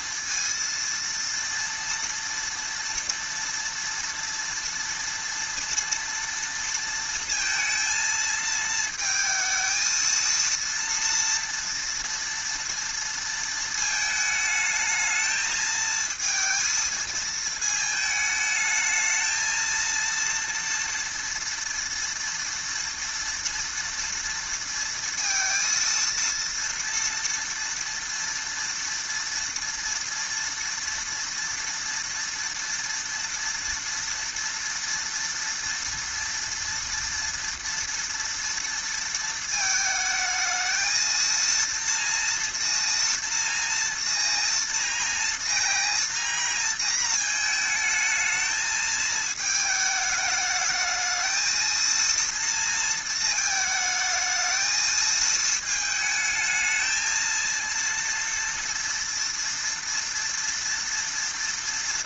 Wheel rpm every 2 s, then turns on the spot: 230, 230, 230, 230, 230, 230, 230, 220, 220, 220, 230, 230, 230, 230, 230, 230, 230, 230, 230, 230, 220, 230, 230, 230, 220, 220, 230, 220, 220, 230, 230.
none